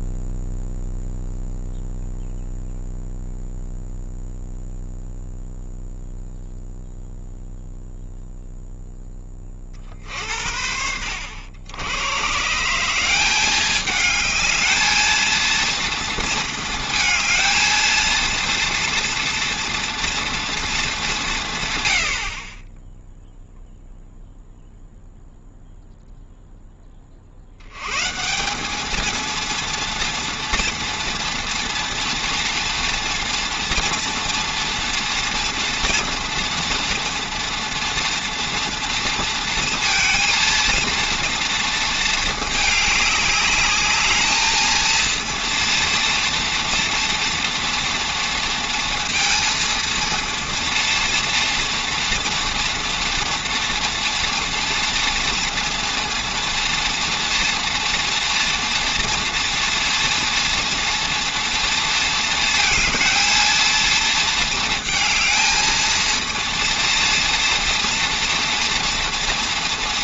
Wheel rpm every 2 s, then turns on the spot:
0, 0, 0, 0, 10, 70, 160, 220, 220, 230, 220, 20, 0, 10, 200, 240, 230, 230, 230, 230, 230, 210, 220, 230, 230, 230, 230, 230, 230, 230, 230, 220, 230, 230, 230.
none